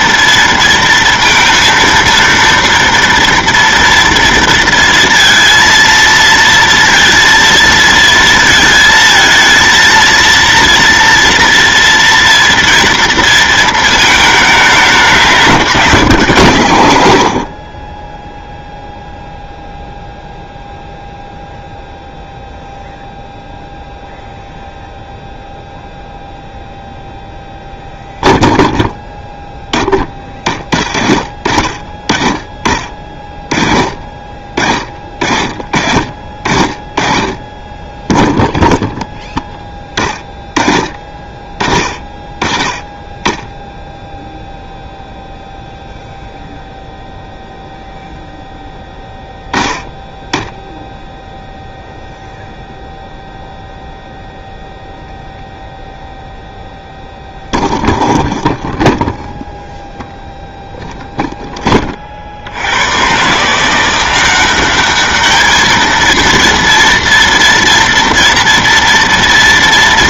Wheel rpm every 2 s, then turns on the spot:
230, 230, 230, 230, 220, 230, 230, 200, 110, 0, 0, 0, 0, 0, 0, 20, 20, 30, 40, 0, 20, 20, 0, 0, 0, 0, 0, 0, 0, 0, 0, 70, 190, 230, 230.
none